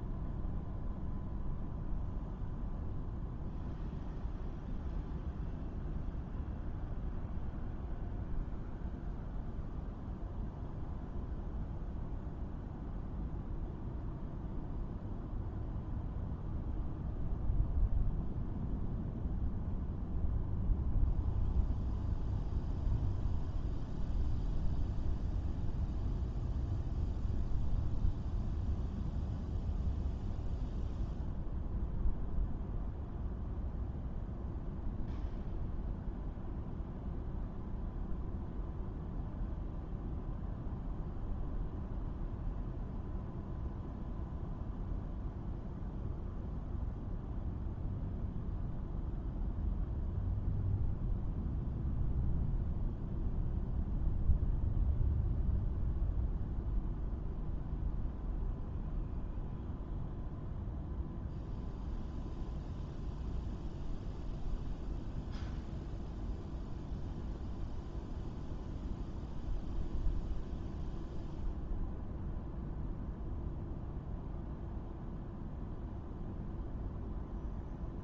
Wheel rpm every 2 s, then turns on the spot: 0, 0, 0, 0, 0, 0, 0, 0, 0, 0, 0, 0, 0, 0, 0, 0, 0, 0, 0, 0, 0, 0, 0, 0, 0, 0, 0, 0, 0, 0, 0, 0, 0, 0, 0, 0, 0, 0, 0.
none